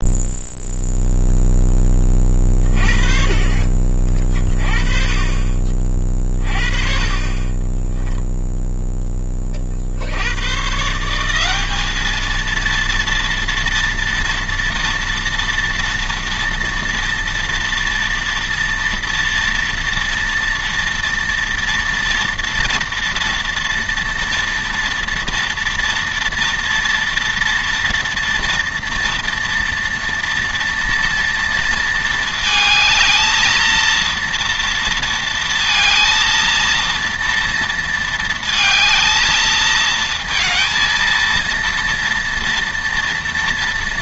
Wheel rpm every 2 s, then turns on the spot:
0, 30, 30, 30, 10, 150, 230, 230, 230, 230, 230, 230, 230, 230, 240, 230, 220, 230, 230, 220, 230, 230.
none